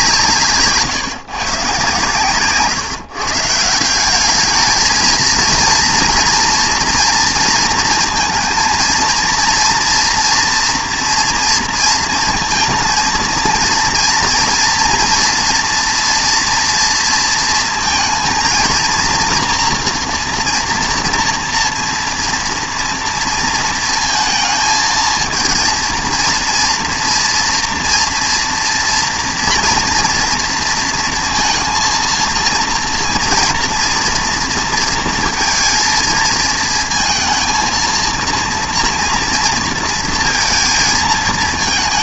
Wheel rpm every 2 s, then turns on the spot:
140, 140, 210, 230, 230, 230, 220, 230, 240, 230, 240, 230, 220, 230, 230, 230, 230, 230, 230, 230, 230.
2-4